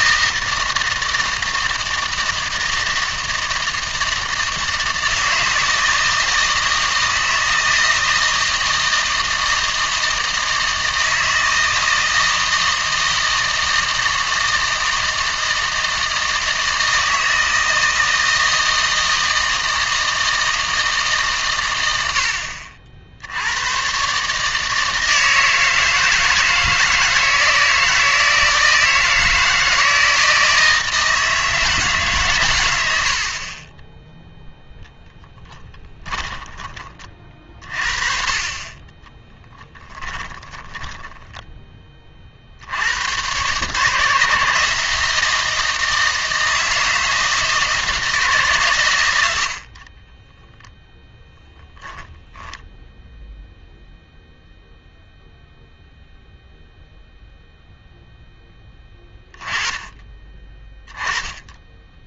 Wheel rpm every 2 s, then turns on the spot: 160, 160, 160, 160, 160, 160, 160, 160, 160, 160, 160, 60, 160, 160, 160, 160, 100, 0, 20, 20, 20, 60, 150, 160, 120, 0, 0, 0, 0, 10, 20.
40-42